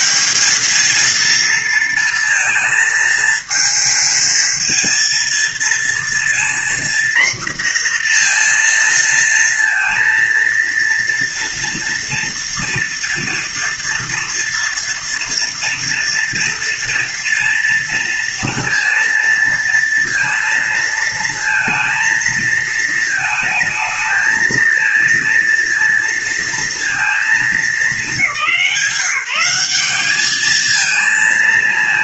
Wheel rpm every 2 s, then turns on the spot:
220, 230, 230, 240, 230, 230, 240, 240, 230, 230, 230, 220, 230, 230, 180, 220.
none